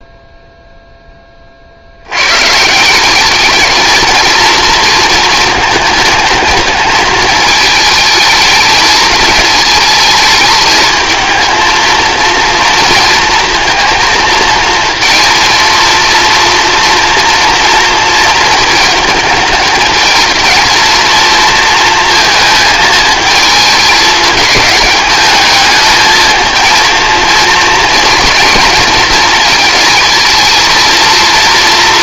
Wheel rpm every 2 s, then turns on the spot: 0, 130, 230, 230, 220, 220, 230, 230, 230, 230, 220, 220, 210, 230, 230, 220.
none